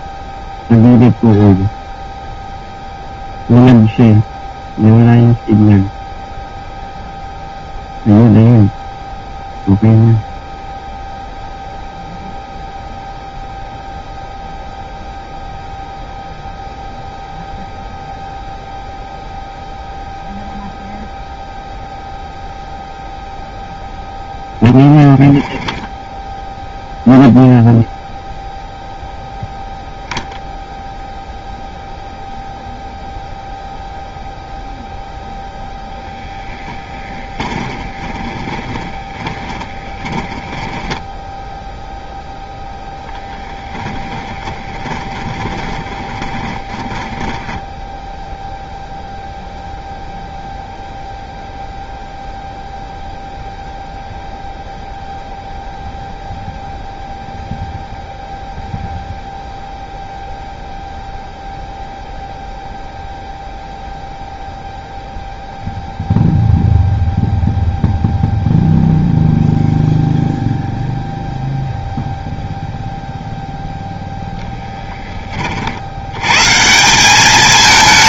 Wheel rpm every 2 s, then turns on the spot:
0, 0, 0, 0, 0, 0, 0, 0, 0, 0, 0, 0, 0, 0, 0, 0, 0, 0, 20, 20, 10, 0, 20, 20, 0, 0, 0, 0, 0, 0, 0, 0, 0, 0, 0, 0, 0, 0, 150.
36-42 44-48